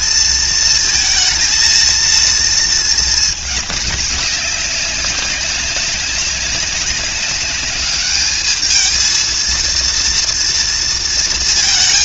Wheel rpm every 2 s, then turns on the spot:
230, 220, 200, 190, 220, 230.
none